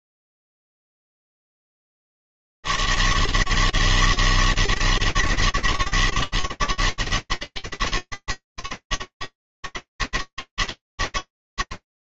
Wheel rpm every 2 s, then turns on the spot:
80, 160, 160, 160, 160, 160.
none